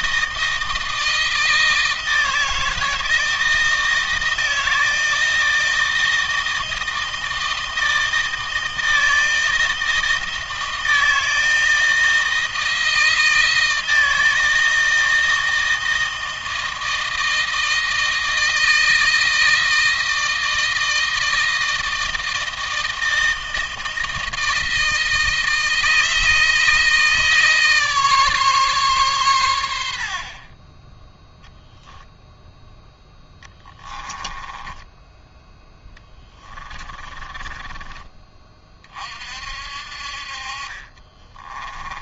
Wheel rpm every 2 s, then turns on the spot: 160, 160, 160, 160, 160, 160, 160, 160, 160, 160, 160, 160, 160, 160, 130, 10, 0, 20, 30, 40, 30.
36-38 40-42